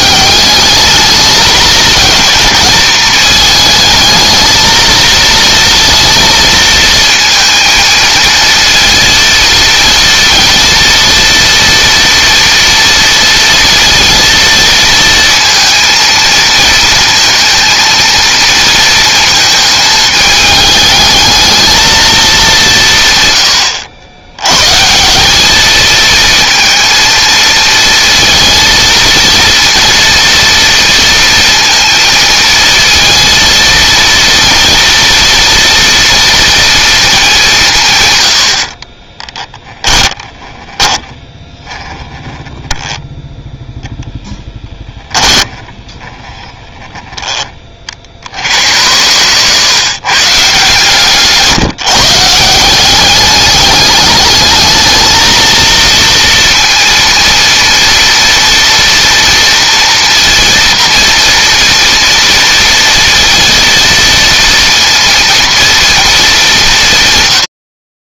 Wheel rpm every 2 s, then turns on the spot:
210, 220, 220, 230, 230, 230, 230, 230, 220, 230, 220, 170, 150, 230, 230, 230, 230, 230, 220, 40, 10, 10, 10, 10, 110, 150, 180, 220, 230, 230, 230, 230, 240, 160.
38-42 44-46